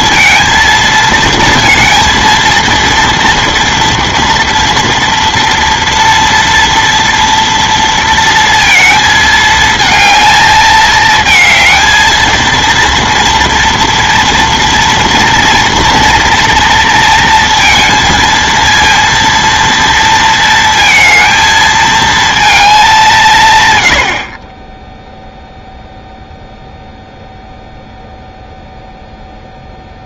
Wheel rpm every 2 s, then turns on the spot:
230, 230, 230, 230, 230, 220, 230, 230, 230, 230, 230, 220, 30, 0, 0.
none